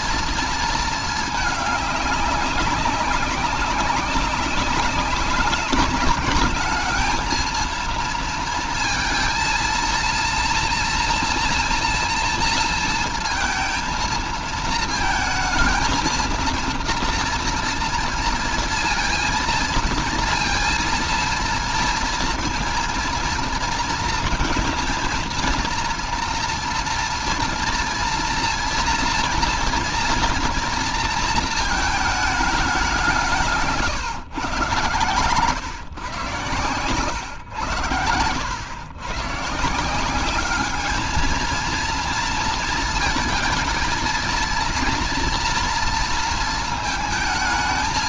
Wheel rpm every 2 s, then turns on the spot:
230, 200, 190, 210, 230, 230, 230, 220, 230, 230, 230, 230, 230, 230, 230, 230, 210, 130, 130, 100, 200, 230, 230, 230.
none